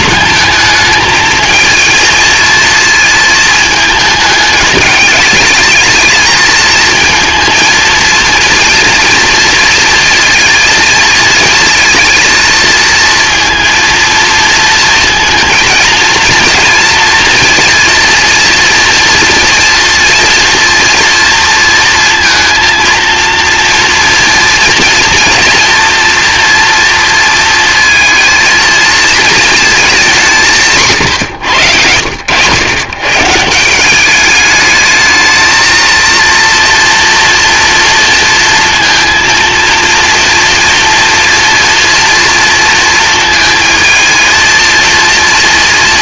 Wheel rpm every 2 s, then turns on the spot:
220, 220, 210, 230, 230, 220, 230, 230, 230, 230, 230, 230, 230, 230, 230, 110, 150, 220, 230, 230, 230, 220, 230.
30-32